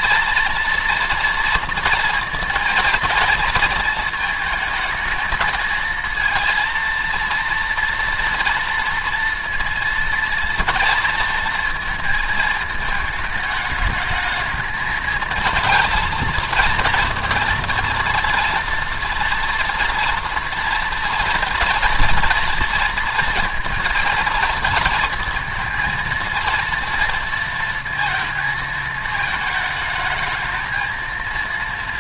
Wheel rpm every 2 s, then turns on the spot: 230, 230, 220, 230, 230, 230, 220, 220, 230, 230, 240, 230, 230, 230, 220, 220.
none